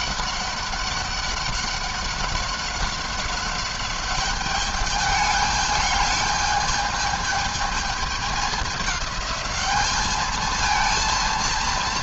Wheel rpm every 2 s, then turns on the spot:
200, 190, 200, 210, 210, 220.
none